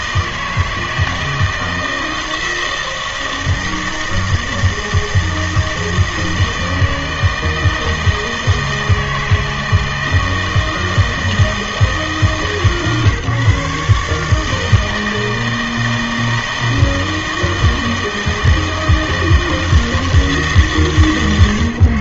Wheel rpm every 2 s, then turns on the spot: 160, 160, 160, 160, 160, 160, 150, 160, 160, 160, 150.
none